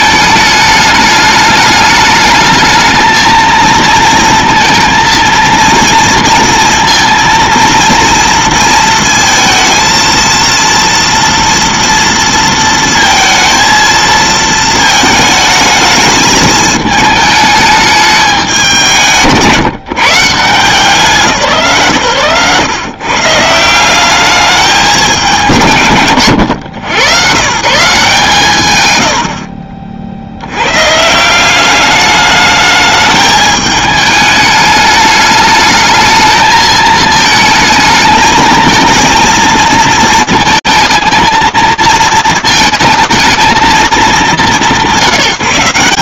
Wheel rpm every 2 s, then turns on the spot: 220, 210, 230, 230, 230, 230, 230, 230, 220, 210, 150, 140, 200, 110, 190, 40, 210, 210, 210, 220, 230, 220, 170.
none